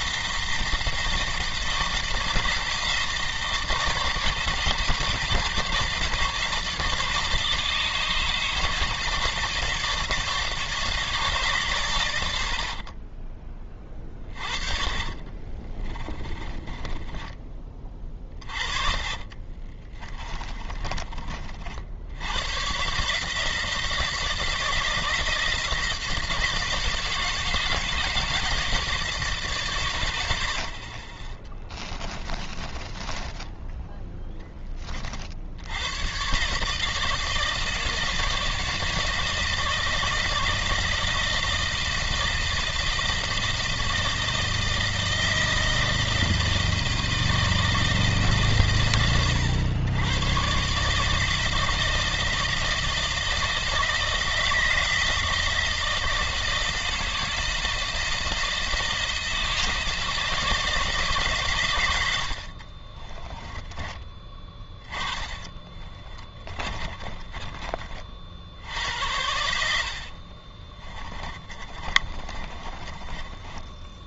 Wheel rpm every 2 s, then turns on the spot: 170, 160, 150, 150, 160, 150, 50, 30, 30, 40, 30, 120, 160, 160, 160, 30, 20, 20, 150, 160, 160, 160, 160, 160, 100, 130, 160, 160, 160, 160, 160, 50, 20, 30, 80, 30, 30.
12-22 30-34 62-64 66-68 70-74